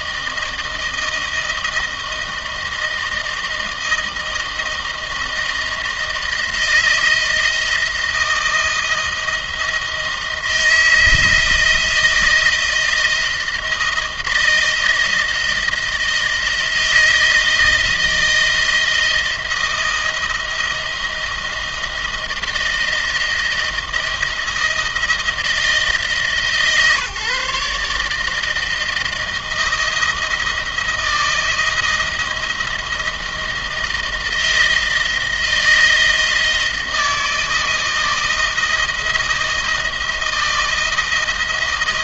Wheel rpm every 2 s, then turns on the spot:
160, 160, 160, 160, 170, 160, 170, 160, 160, 160, 160, 170, 160, 140, 160, 160, 160, 160, 160, 160, 170.
none